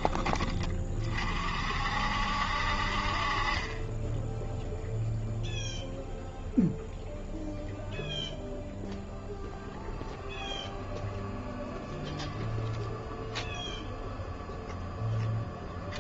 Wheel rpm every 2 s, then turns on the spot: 30, 50, 0, 0, 0, 0, 0, 0.
none